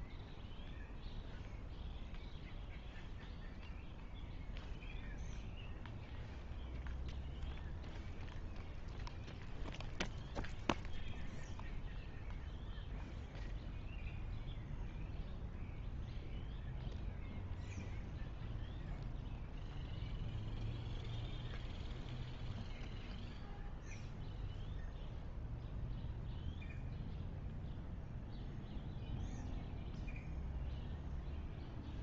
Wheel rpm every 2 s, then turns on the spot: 0, 0, 0, 0, 0, 0, 0, 0, 0, 0, 0, 0, 0, 0, 0, 0.
none